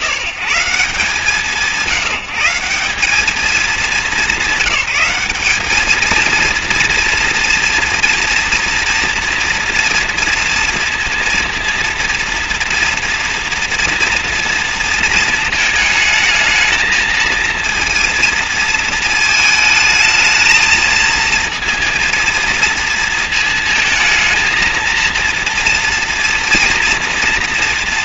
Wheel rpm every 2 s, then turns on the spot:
110, 180, 200, 230, 230, 230, 230, 230, 220, 230, 220, 230, 220, 230.
none